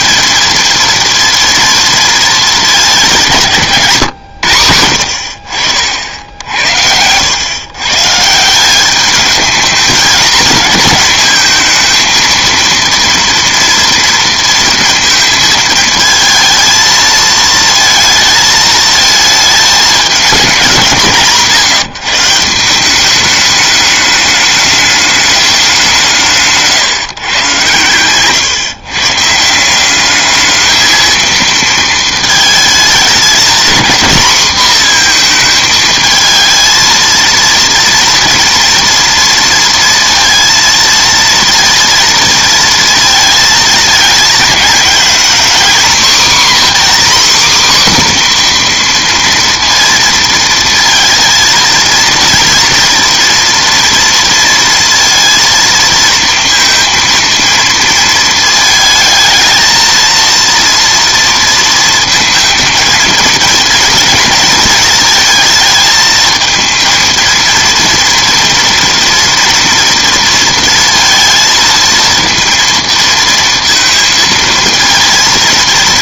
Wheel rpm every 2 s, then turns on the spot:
230, 210, 90, 80, 190, 220, 230, 230, 220, 220, 190, 180, 210, 150, 120, 220, 220, 240, 220, 230, 230, 230, 220, 270, 250, 230, 230, 230, 230, 220, 230, 220, 230, 230, 240, 230, 230, 220.
none